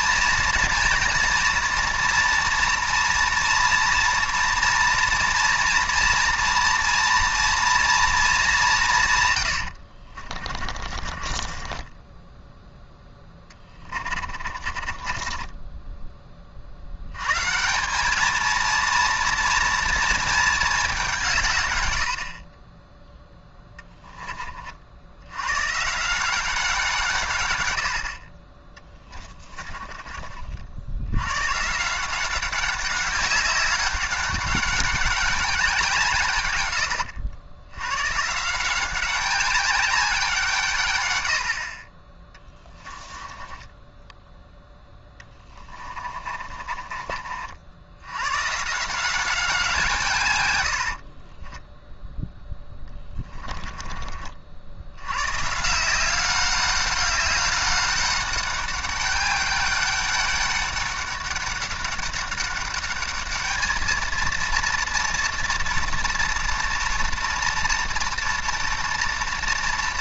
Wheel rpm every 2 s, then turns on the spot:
230, 230, 240, 240, 170, 40, 10, 30, 60, 230, 210, 20, 40, 180, 20, 60, 190, 200, 100, 180, 140, 20, 10, 30, 150, 80, 10, 80, 200, 200, 200, 200, 230, 230, 230.
10-12 14-16 28-30 42-44 46-48 50-54